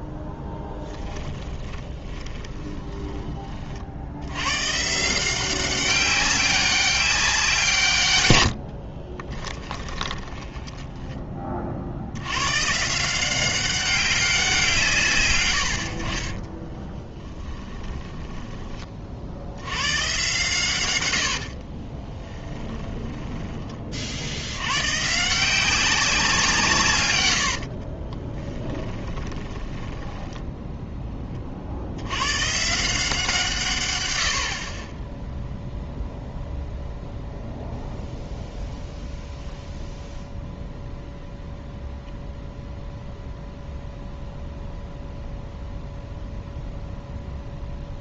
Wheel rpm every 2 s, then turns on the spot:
10, 20, 120, 200, 80, 20, 130, 170, 20, 20, 120, 10, 100, 160, 20, 10, 140, 50, 0, 0, 0, 0, 0, 0.
0-4 8-12 16-18 22-24 28-30